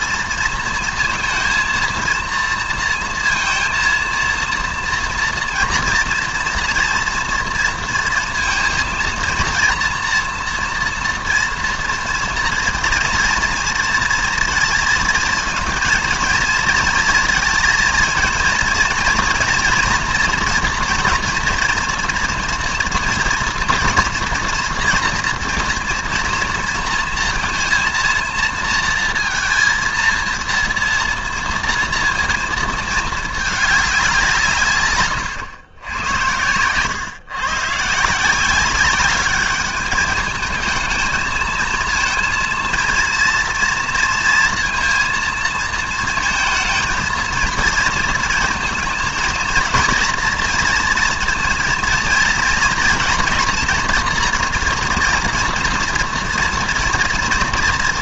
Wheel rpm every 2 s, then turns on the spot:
230, 230, 230, 230, 230, 230, 230, 230, 230, 230, 240, 240, 240, 230, 230, 230, 220, 130, 120, 190, 220, 230, 230, 230, 220, 230, 230, 240, 230.
none